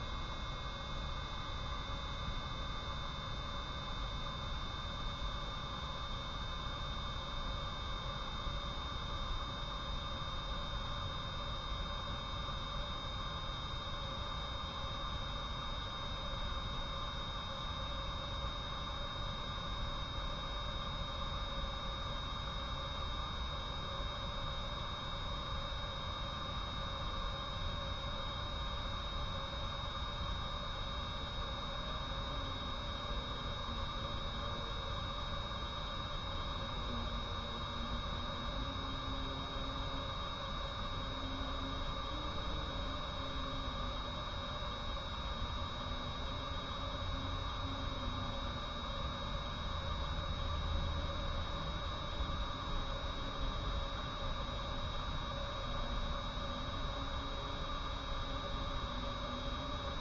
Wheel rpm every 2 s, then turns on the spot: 0, 0, 0, 0, 0, 0, 0, 0, 0, 0, 0, 0, 0, 0, 0, 0, 0, 0, 0, 0, 0, 0, 0, 0, 0, 0, 0, 0, 0, 0.
none